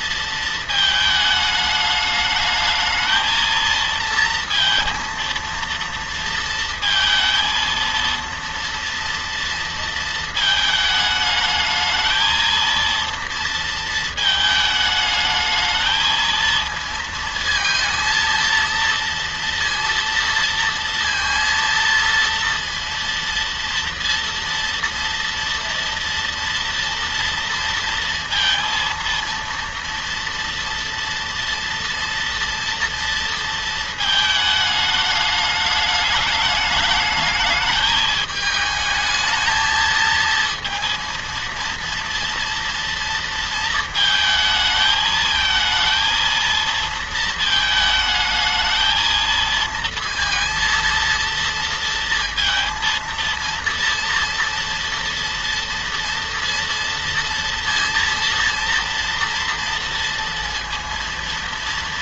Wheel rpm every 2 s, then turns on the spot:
220, 220, 230, 230, 230, 220, 230, 220, 220, 230, 230, 230, 230, 230, 230, 230, 230, 210, 210, 220, 230, 230, 220, 230, 220, 230, 230, 230, 230, 230, 230.
none